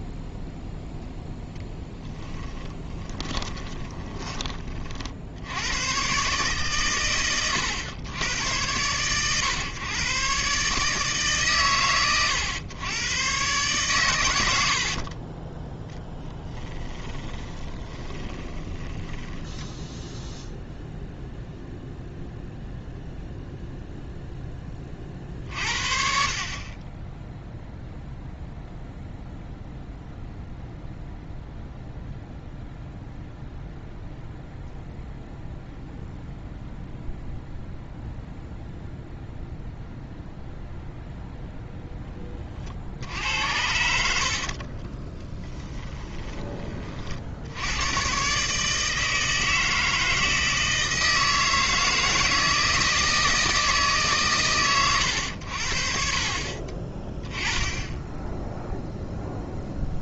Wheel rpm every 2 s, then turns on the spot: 0, 20, 50, 120, 110, 150, 110, 60, 10, 20, 0, 0, 30, 20, 0, 0, 0, 0, 0, 0, 0, 50, 40, 40, 160, 160, 160, 120, 30, 0.
2-4 14-20 44-46